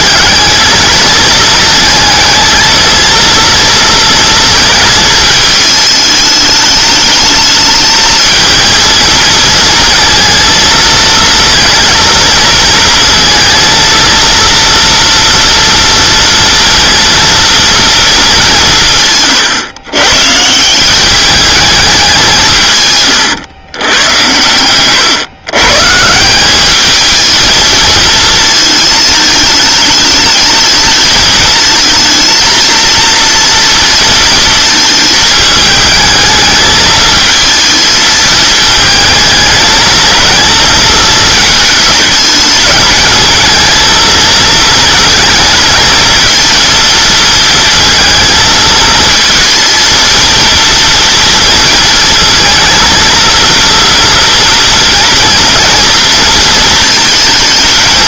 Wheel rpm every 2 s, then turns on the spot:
220, 230, 220, 210, 230, 230, 230, 230, 230, 190, 170, 150, 120, 200, 220, 210, 230, 220, 220, 220, 220, 210, 230, 230, 220, 230, 230, 230, 220.
24-26